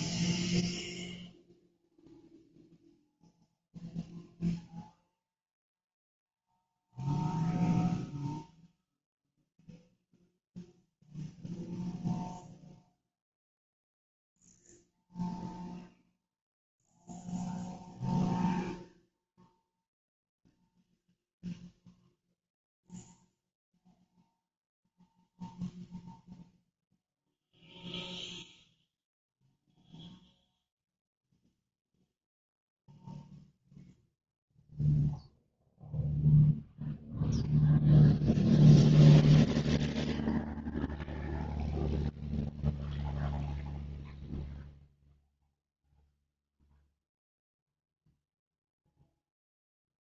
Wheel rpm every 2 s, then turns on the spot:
0, 0, 0, 0, 0, 0, 0, 0, 0, 0, 0, 0, 0, 0, 0, 0, 0, 0, 0, 0, 0, 0, 0, 0, 0.
none